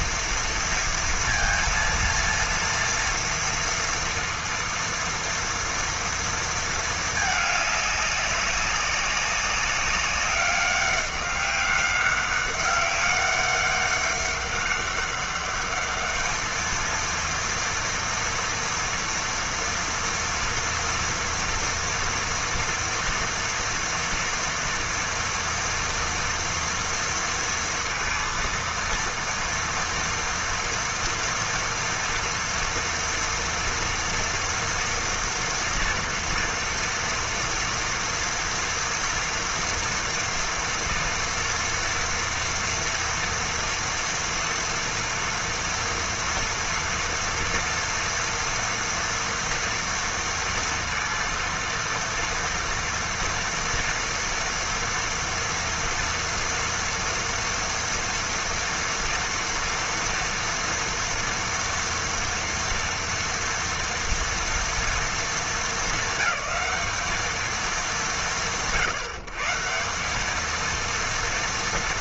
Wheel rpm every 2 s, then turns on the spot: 230, 230, 230, 230, 200, 200, 200, 200, 220, 240, 230, 230, 230, 240, 230, 230, 240, 230, 230, 230, 230, 230, 230, 230, 230, 230, 230, 230, 230, 240, 240, 230, 230, 210, 120, 220.
none